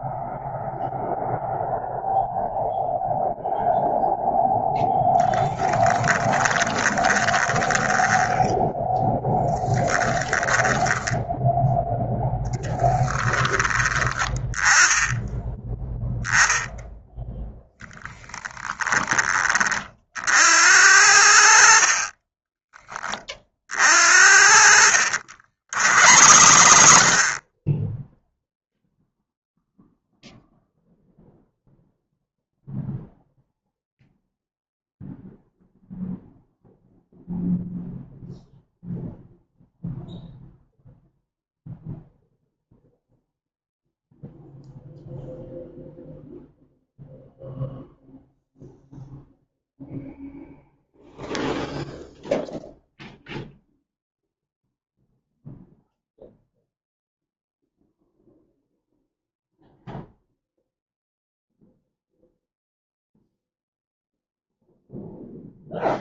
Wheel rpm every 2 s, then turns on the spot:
0, 0, 10, 20, 10, 10, 10, 10, 0, 20, 60, 30, 80, 70, 0, 0, 0, 0, 0, 0, 0, 0, 0, 0, 0, 0, 0, 0, 0, 0, 0, 0, 0.
4-10 24-28